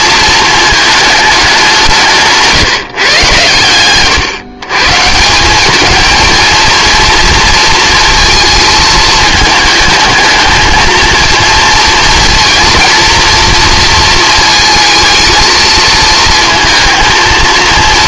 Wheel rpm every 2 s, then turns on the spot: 220, 150, 140, 230, 220, 220, 230, 230, 220.
none